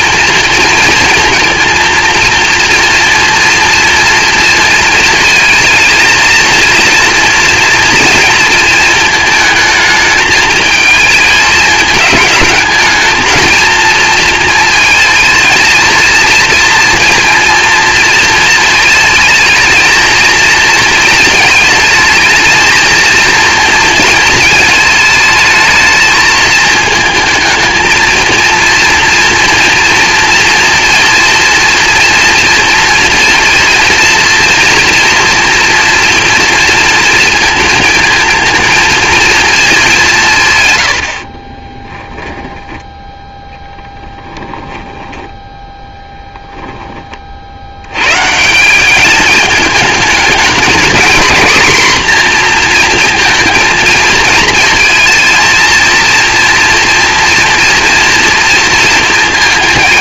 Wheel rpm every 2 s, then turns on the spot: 230, 230, 230, 230, 230, 220, 220, 230, 230, 220, 230, 220, 220, 220, 230, 230, 230, 230, 230, 230, 140, 10, 10, 10, 170, 230, 240, 220, 230, 230.
44-46